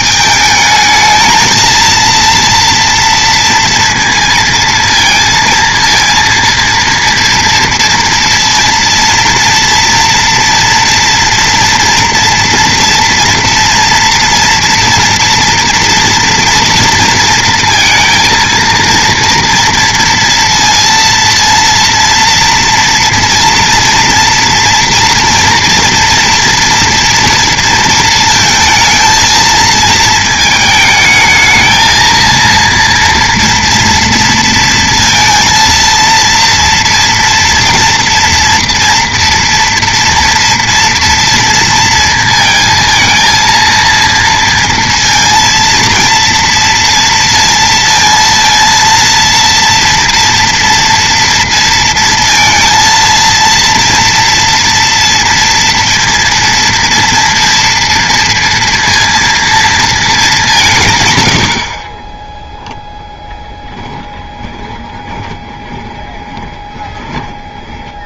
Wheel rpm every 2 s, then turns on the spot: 220, 230, 230, 230, 230, 230, 230, 230, 230, 230, 230, 230, 230, 230, 230, 220, 230, 230, 230, 230, 230, 220, 230, 230, 230, 240, 230, 230, 230, 230, 170, 0, 20, 20.
64-68